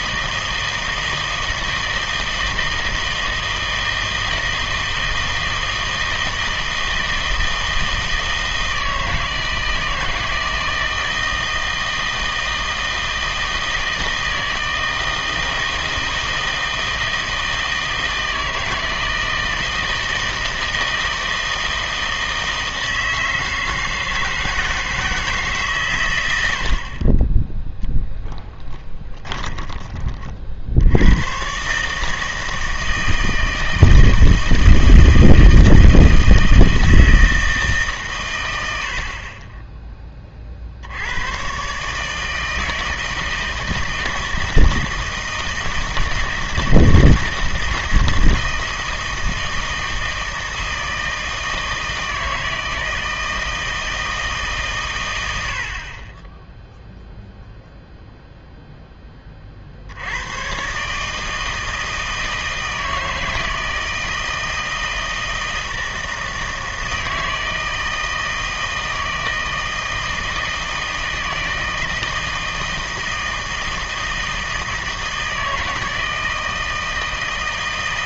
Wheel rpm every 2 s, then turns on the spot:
160, 160, 160, 160, 160, 160, 160, 160, 160, 160, 160, 160, 160, 70, 10, 60, 160, 160, 160, 90, 50, 160, 160, 160, 160, 160, 160, 140, 10, 0, 130, 160, 160, 160, 160, 160, 160, 160, 160.
28-30